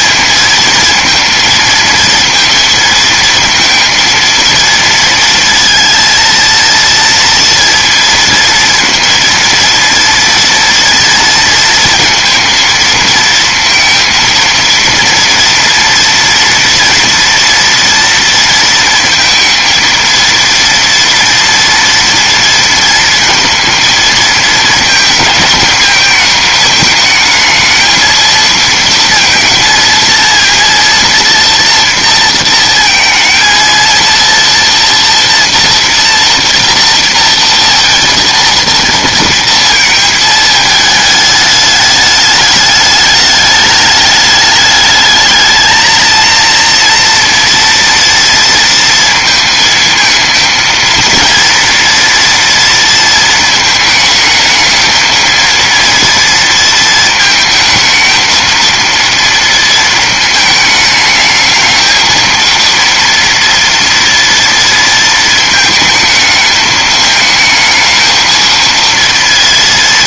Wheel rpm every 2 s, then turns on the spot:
230, 230, 230, 230, 230, 230, 230, 230, 230, 230, 230, 230, 230, 220, 230, 230, 230, 230, 230, 230, 220, 210, 210, 230, 230, 230, 230, 220, 230, 230, 220, 230, 230, 220, 230.
none